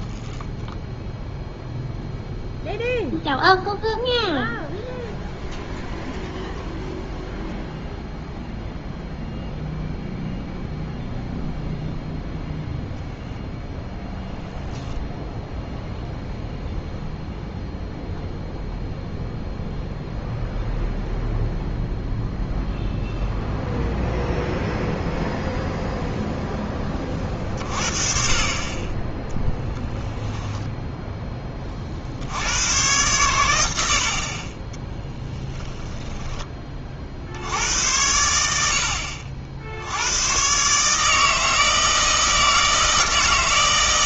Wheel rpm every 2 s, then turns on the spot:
0, 0, 0, 0, 0, 0, 0, 0, 0, 0, 0, 0, 0, 20, 20, 10, 100, 10, 20, 80, 140, 160.
none